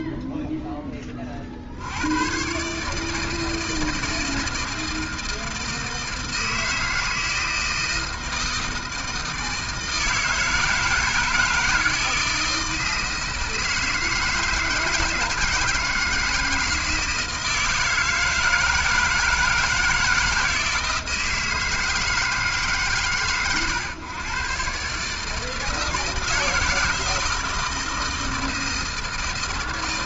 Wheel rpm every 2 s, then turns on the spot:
50, 160, 160, 160, 160, 160, 160, 160, 160, 160, 160, 110, 160, 160, 160.
none